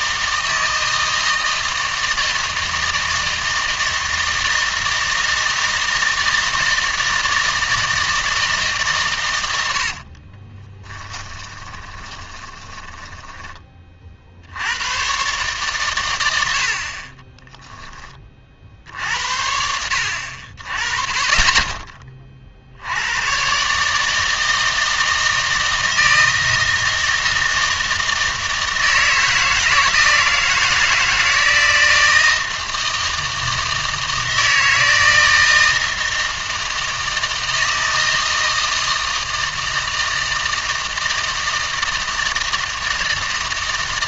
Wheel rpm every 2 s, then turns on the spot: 160, 160, 160, 160, 160, 20, 20, 90, 50, 60, 30, 80, 160, 160, 160, 160, 160, 160, 160, 160, 160, 160.
10-14